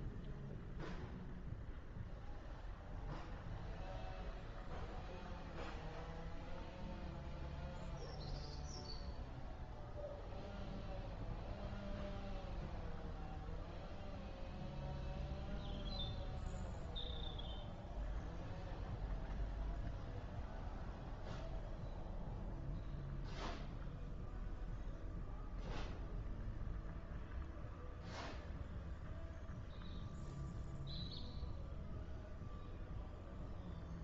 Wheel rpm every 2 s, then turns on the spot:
0, 0, 0, 0, 0, 0, 0, 0, 0, 0, 0, 0, 0, 0, 0, 0, 0.
none